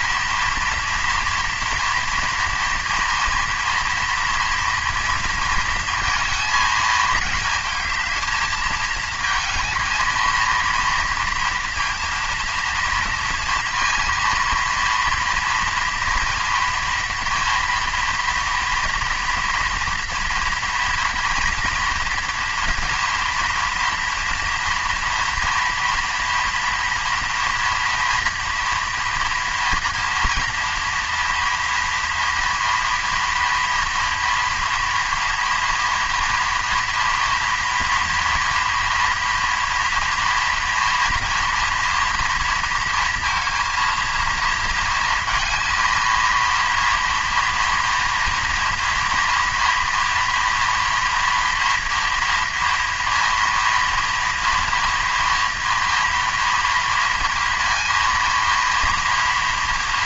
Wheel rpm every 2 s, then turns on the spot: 230, 230, 230, 220, 220, 230, 230, 230, 230, 230, 230, 240, 230, 230, 240, 230, 230, 230, 230, 230, 230, 230, 230, 230, 230, 230, 240, 230, 230, 230.
none